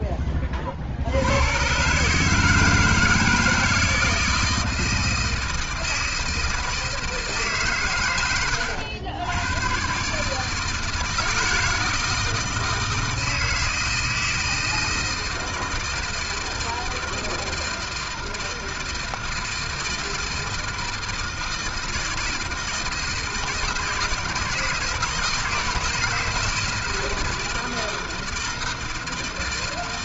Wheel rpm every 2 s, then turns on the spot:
70, 160, 160, 160, 90, 160, 160, 160, 160, 160, 160, 160, 170, 170, 160.
none